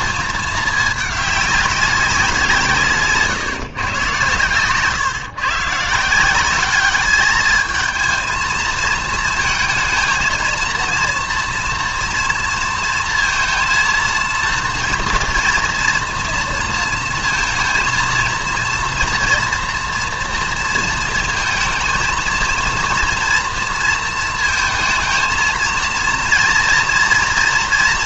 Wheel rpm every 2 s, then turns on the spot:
210, 170, 130, 200, 220, 230, 230, 230, 230, 230, 230, 230, 220, 230.
4-6